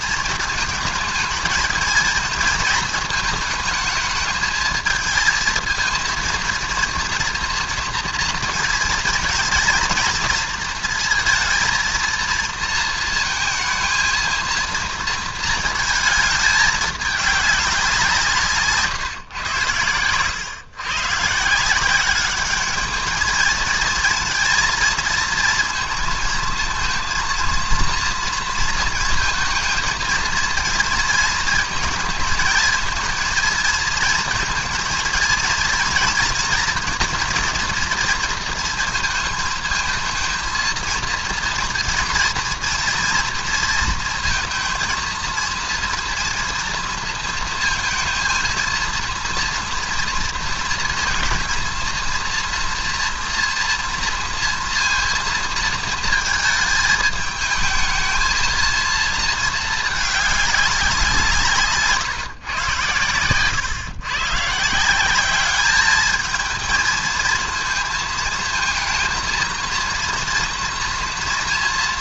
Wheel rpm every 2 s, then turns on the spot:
230, 230, 220, 220, 230, 230, 230, 230, 220, 170, 100, 200, 230, 230, 230, 230, 220, 230, 230, 230, 220, 230, 230, 230, 230, 230, 230, 230, 220, 220, 210, 150, 130, 220, 220, 230.
none